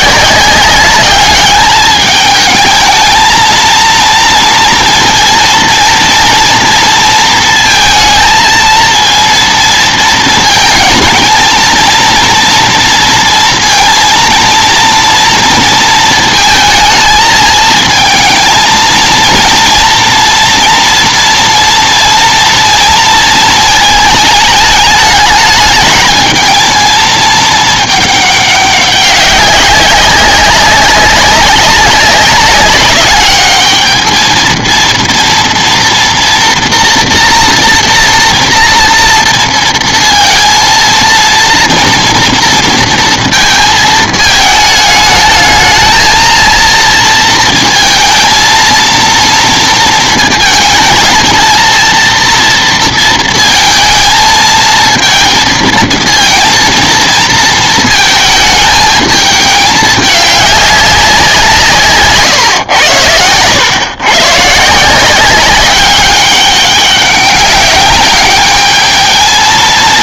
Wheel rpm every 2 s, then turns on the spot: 190, 210, 230, 230, 230, 230, 230, 230, 220, 230, 230, 230, 210, 220, 200, 200, 200, 230, 230, 230, 230, 230, 210, 230, 230, 230, 230, 220, 230, 220, 200, 130, 150, 200, 210.
none